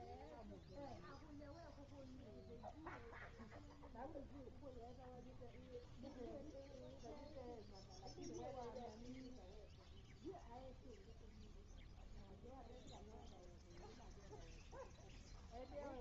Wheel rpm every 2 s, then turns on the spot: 0, 0, 0, 0, 0, 0, 0, 0.
none